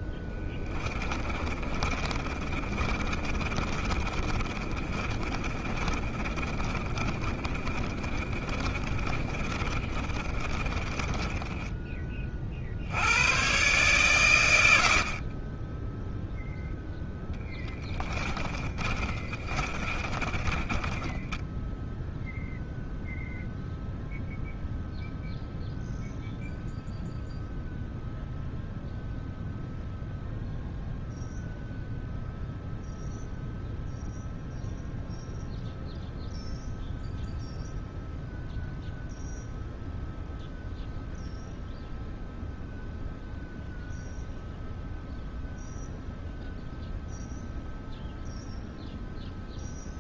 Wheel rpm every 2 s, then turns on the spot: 30, 40, 30, 30, 30, 30, 90, 50, 10, 30, 20, 0, 0, 0, 0, 0, 0, 0, 0, 0, 0, 0, 0, 0, 0.
0-12 18-22